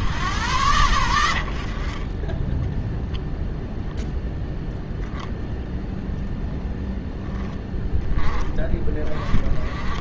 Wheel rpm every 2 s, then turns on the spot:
20, 0, 0, 10, 30.
none